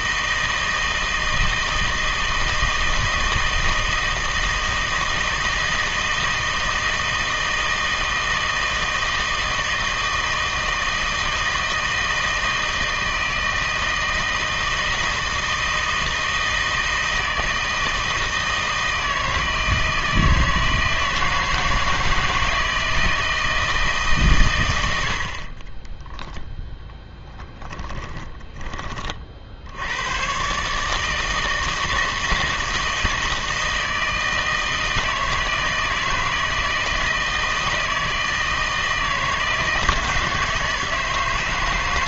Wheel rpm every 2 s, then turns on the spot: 160, 160, 160, 160, 160, 160, 160, 160, 160, 160, 160, 160, 100, 10, 20, 140, 160, 160, 160, 160, 160.
none